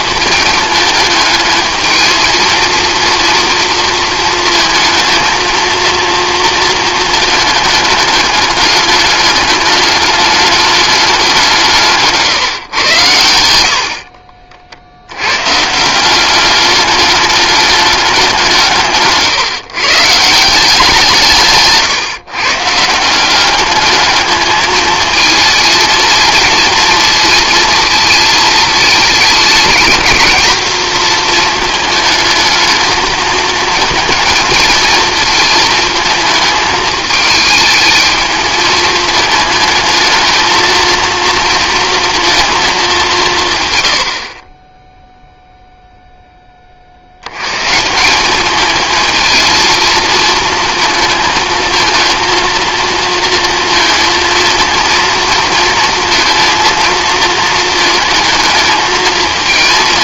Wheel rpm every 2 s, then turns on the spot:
220, 230, 230, 220, 210, 210, 130, 40, 200, 160, 170, 150, 220, 230, 220, 230, 220, 230, 220, 220, 230, 220, 20, 30, 220, 230, 230, 230, 230, 220.
none